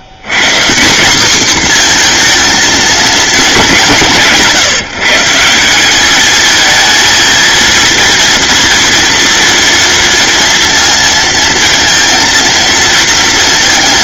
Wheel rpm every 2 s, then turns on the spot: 180, 230, 150, 220, 230, 230, 230.
none